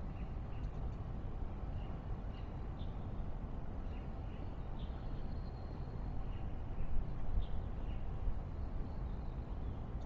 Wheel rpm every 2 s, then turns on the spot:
0, 0, 0, 0, 0.
none